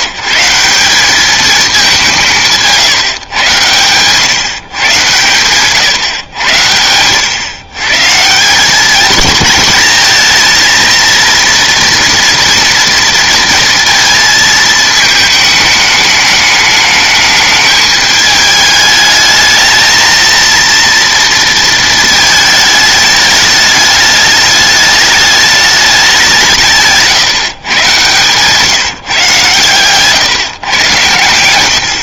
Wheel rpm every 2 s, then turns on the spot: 180, 160, 130, 90, 200, 220, 230, 220, 210, 210, 230, 220, 210, 150, 150, 120.
2-4